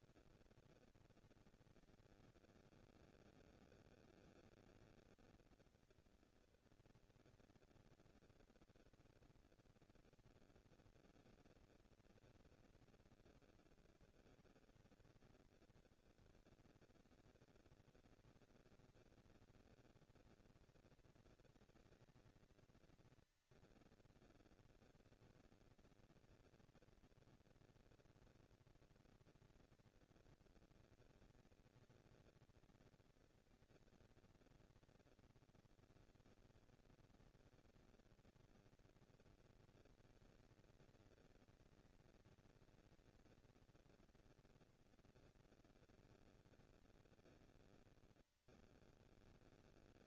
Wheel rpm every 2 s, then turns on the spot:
230, 230, 230, 230, 230, 230, 230, 220, 200, 190, 210, 230, 230, 230, 230, 230, 230, 230, 230, 230, 230, 230, 230, 230, 210.
none